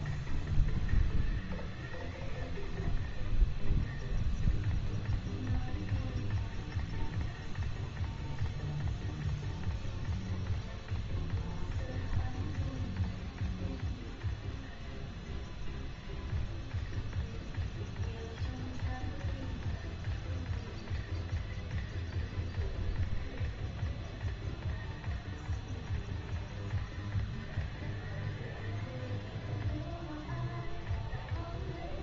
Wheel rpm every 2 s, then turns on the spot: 0, 0, 0, 0, 0, 0, 0, 0, 0, 0, 0, 0, 0, 0, 0, 0.
none